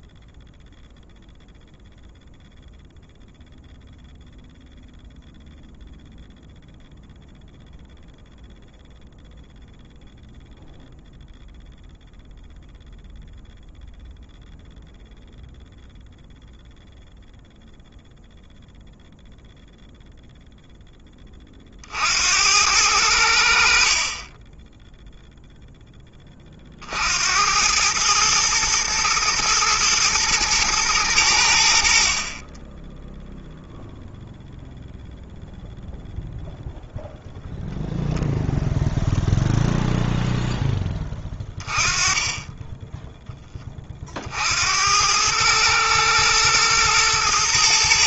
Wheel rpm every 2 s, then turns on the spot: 0, 0, 0, 0, 0, 0, 0, 0, 0, 0, 0, 90, 10, 50, 120, 110, 10, 0, 0, 0, 10, 10, 80, 120.
none